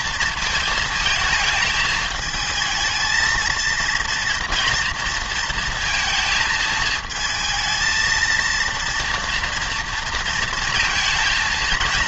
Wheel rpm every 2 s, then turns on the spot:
230, 220, 230, 220, 230, 230.
none